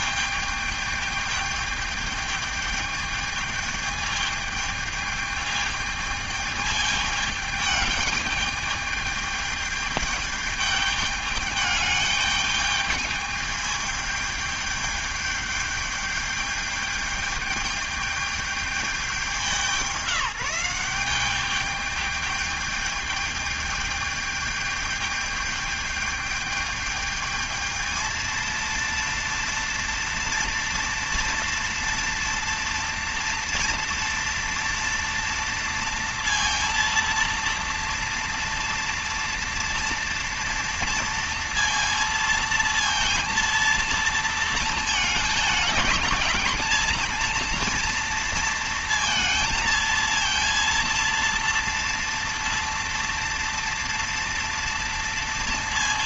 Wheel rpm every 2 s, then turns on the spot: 210, 210, 210, 210, 210, 210, 210, 210, 210, 200, 180, 210, 210, 210, 230, 230, 230, 230, 230, 230, 230, 230, 220, 220, 230, 230, 230, 230.
none